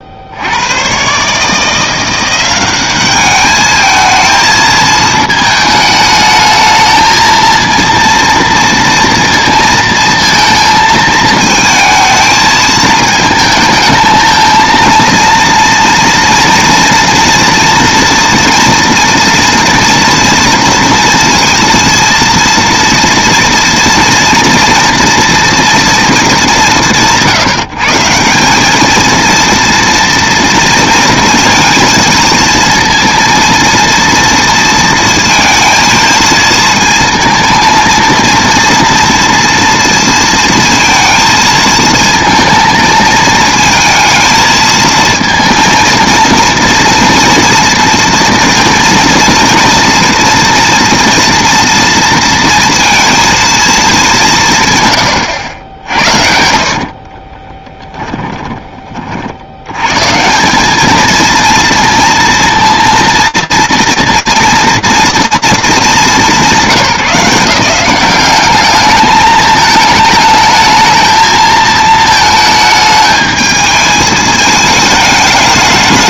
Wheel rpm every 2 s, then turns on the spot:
100, 190, 220, 220, 230, 230, 220, 220, 230, 230, 230, 230, 230, 170, 210, 230, 230, 230, 220, 230, 230, 220, 220, 230, 230, 230, 230, 150, 50, 20, 210, 230, 230, 180, 210, 220, 220, 210.
56-58